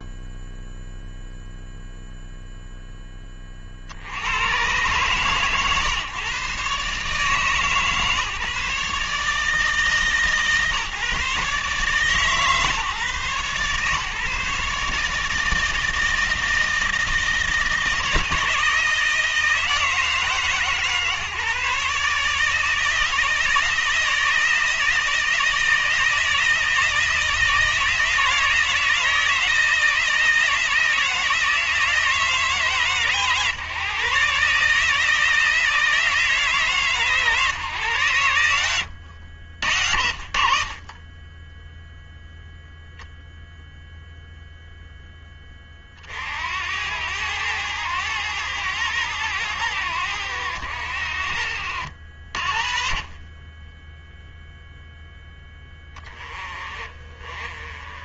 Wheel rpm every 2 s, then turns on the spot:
0, 20, 140, 150, 150, 150, 130, 150, 160, 160, 150, 160, 160, 160, 160, 160, 140, 160, 150, 90, 30, 0, 10, 90, 90, 70, 30, 10, 40.
none